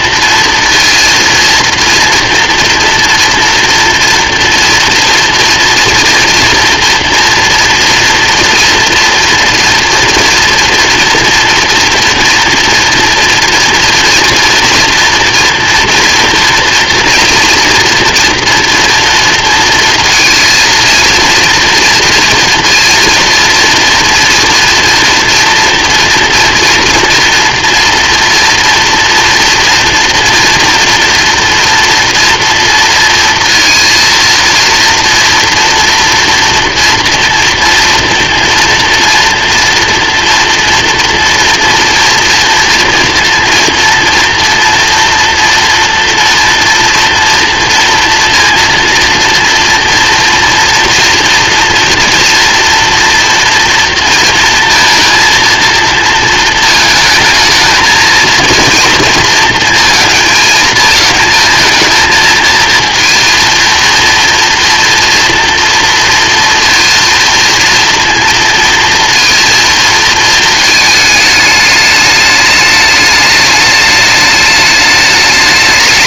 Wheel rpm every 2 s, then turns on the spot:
230, 230, 240, 230, 240, 240, 230, 240, 230, 230, 230, 230, 230, 240, 230, 230, 230, 230, 240, 230, 240, 230, 230, 230, 230, 230, 230, 230, 220, 230, 220, 230, 230, 230, 230, 220, 210, 210.
none